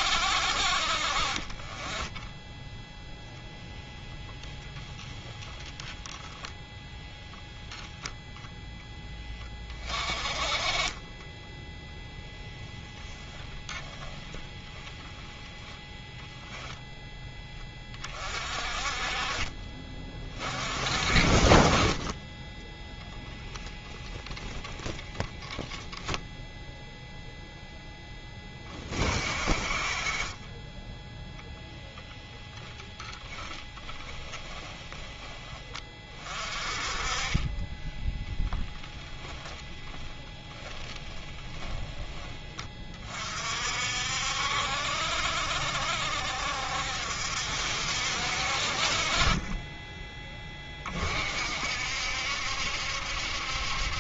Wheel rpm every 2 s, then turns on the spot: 50, 0, 0, 0, 10, 30, 0, 20, 10, 40, 40, 0, 0, 0, 30, 10, 10, 10, 30, 0, 10, 30, 60, 60, 40, 30, 70.
10-12 14-16 30-34 40-42